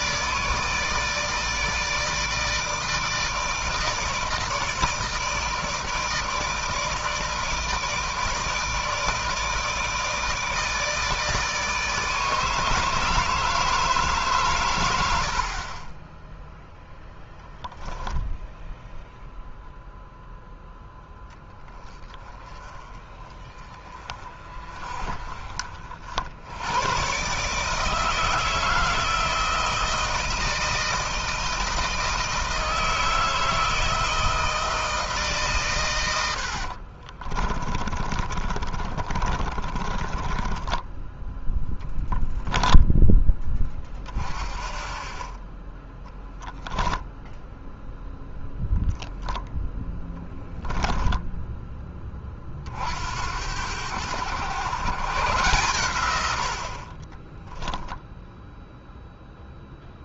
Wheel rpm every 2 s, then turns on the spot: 160, 160, 160, 160, 160, 160, 160, 100, 0, 0, 10, 20, 30, 120, 160, 160, 160, 160, 60, 30, 20, 10, 30, 0, 0, 10, 60, 130, 40, 0.
36-42 56-58